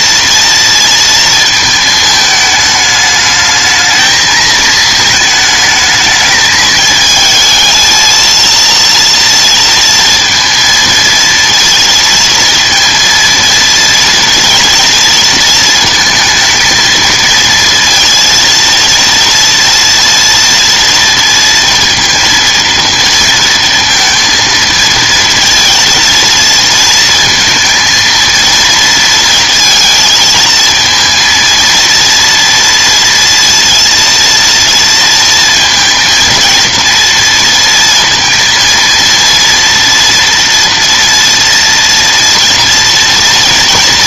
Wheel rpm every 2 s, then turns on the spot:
230, 210, 220, 220, 230, 230, 230, 230, 220, 230, 230, 230, 220, 230, 230, 230, 230, 230, 230, 230, 230, 230.
none